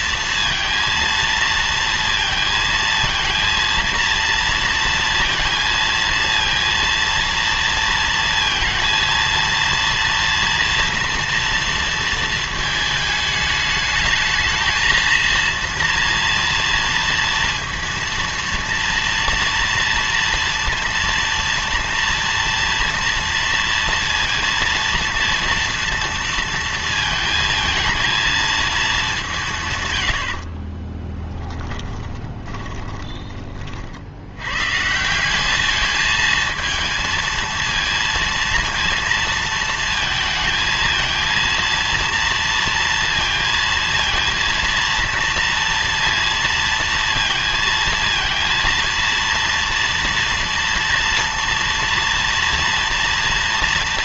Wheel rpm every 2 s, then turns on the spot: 230, 230, 230, 230, 230, 230, 220, 220, 230, 230, 230, 230, 230, 230, 220, 40, 20, 120, 220, 230, 220, 230, 230, 230, 230, 240, 230.
30-34